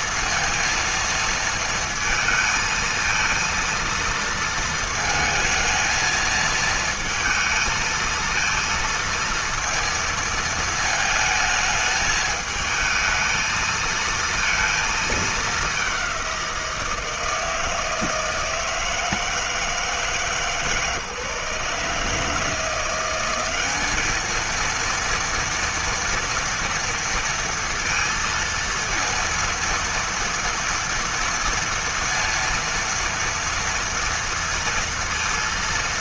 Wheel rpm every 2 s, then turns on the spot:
230, 230, 220, 220, 230, 220, 220, 230, 180, 160, 150, 170, 220, 230, 230, 230, 230, 230.
none